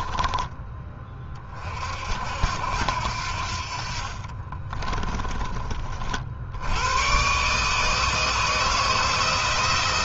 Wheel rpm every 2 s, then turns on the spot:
20, 80, 40, 90, 160.
4-6